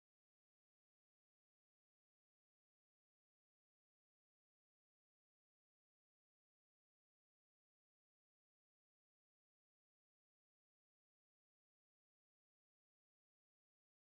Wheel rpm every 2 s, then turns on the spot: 0, 0, 0, 0, 0, 0, 0.
none